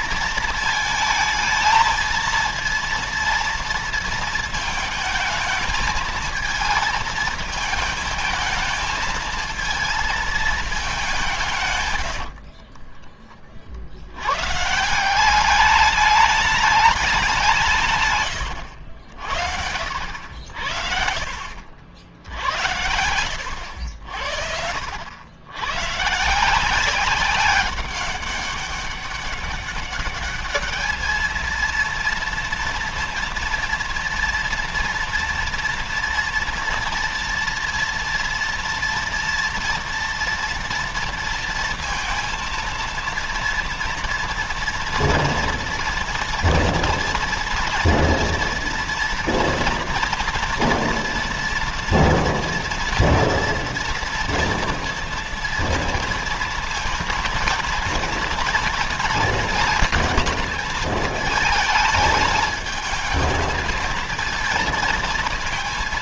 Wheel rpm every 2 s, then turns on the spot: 220, 230, 220, 220, 220, 200, 30, 160, 200, 70, 70, 70, 80, 180, 200, 220, 230, 230, 240, 240, 230, 230, 230, 240, 240, 240, 240, 230, 230, 230, 220, 220, 230.
12-14 20-24